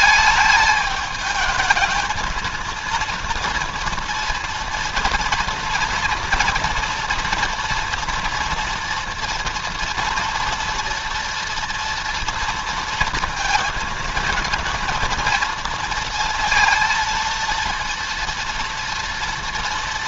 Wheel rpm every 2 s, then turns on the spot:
220, 230, 230, 240, 240, 230, 230, 230, 230, 230.
none